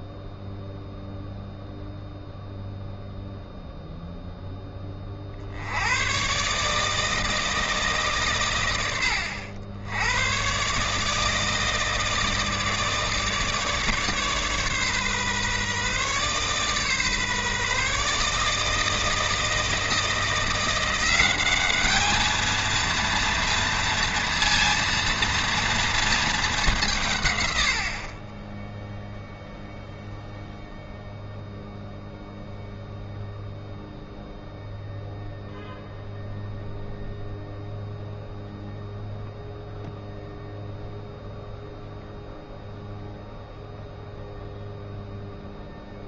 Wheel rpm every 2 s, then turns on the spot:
0, 0, 10, 150, 110, 140, 160, 140, 140, 160, 170, 230, 230, 200, 10, 0, 0, 0, 0, 0, 0, 0, 0.
none